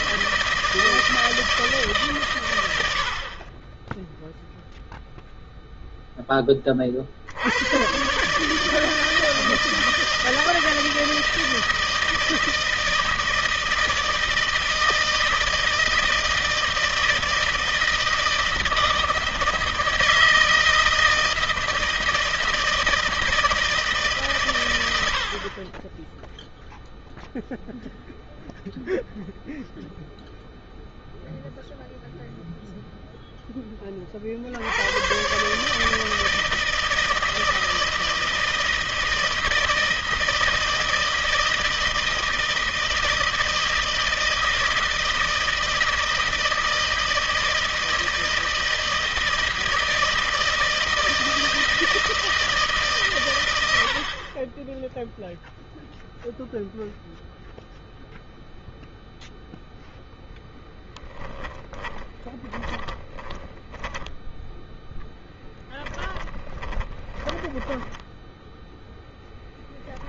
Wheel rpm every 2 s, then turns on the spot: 160, 80, 0, 40, 160, 160, 160, 160, 160, 160, 160, 160, 100, 0, 0, 0, 0, 90, 160, 160, 160, 160, 160, 160, 160, 160, 150, 10, 0, 0, 10, 30, 10, 10, 0.
60-64 66-68